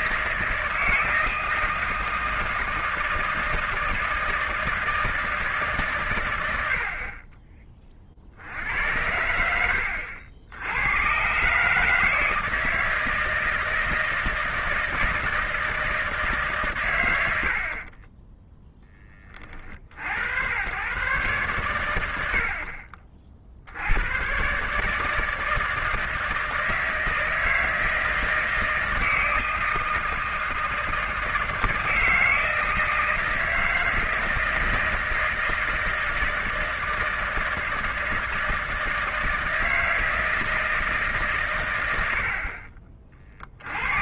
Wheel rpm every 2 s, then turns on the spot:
160, 160, 160, 80, 60, 80, 160, 160, 150, 10, 100, 60, 130, 160, 160, 160, 160, 160, 160, 160, 160, 50.
18-20